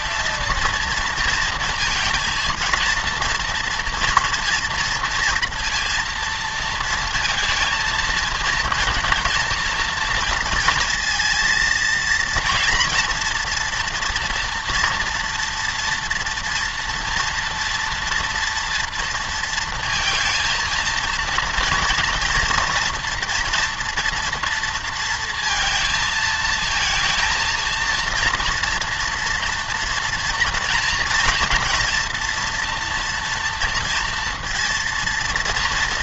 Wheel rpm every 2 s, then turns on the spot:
230, 230, 230, 230, 230, 230, 240, 230, 240, 240, 230, 230, 230, 220, 230, 240, 230, 230.
none